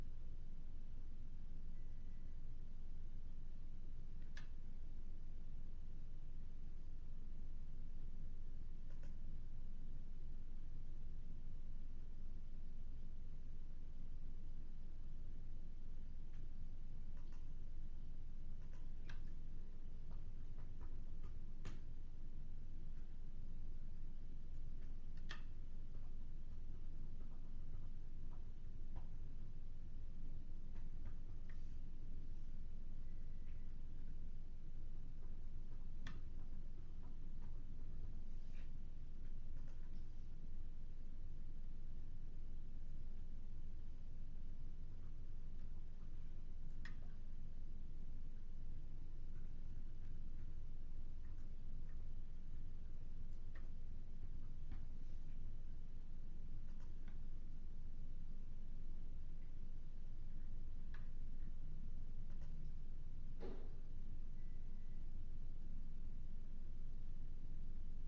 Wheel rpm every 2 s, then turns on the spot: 0, 0, 0, 0, 0, 0, 0, 0, 0, 0, 0, 0, 0, 0, 0, 0, 0, 0, 0, 0, 0, 0, 0, 0, 0, 0, 0, 0, 0, 0, 0, 0, 0, 0.
none